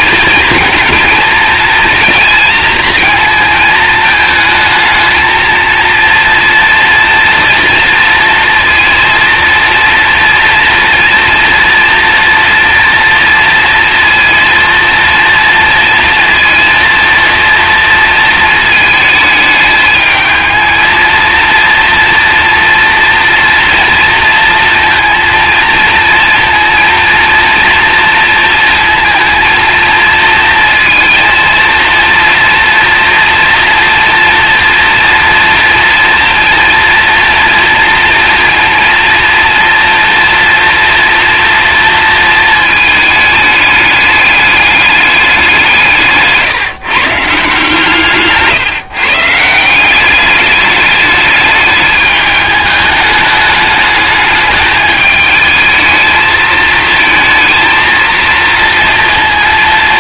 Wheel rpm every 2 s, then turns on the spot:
220, 230, 220, 230, 230, 240, 230, 230, 230, 220, 220, 230, 230, 230, 230, 230, 230, 230, 230, 230, 230, 220, 210, 140, 130, 210, 210, 210, 220, 230.
none